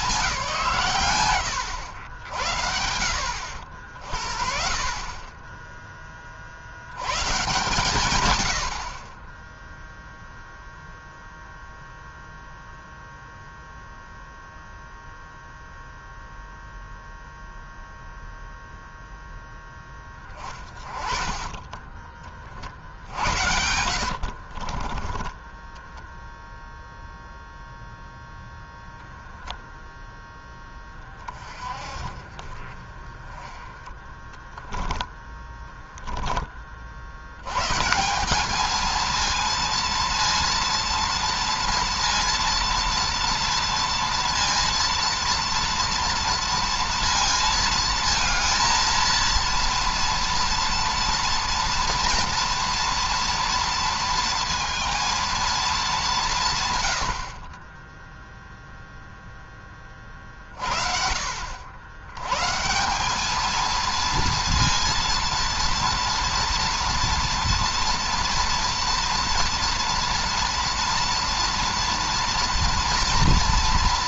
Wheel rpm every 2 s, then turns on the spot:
150, 70, 40, 90, 50, 0, 0, 0, 0, 0, 20, 50, 40, 0, 0, 20, 30, 10, 50, 220, 230, 230, 230, 230, 220, 230, 230, 230, 100, 0, 40, 180, 230, 230, 230, 230, 230.
20-26 34-36